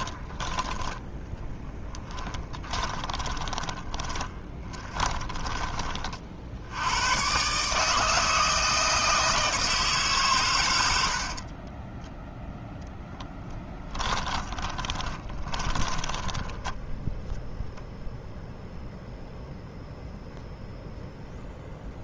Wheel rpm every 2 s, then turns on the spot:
10, 10, 20, 90, 160, 90, 10, 30, 0, 0, 0.
2-6 14-16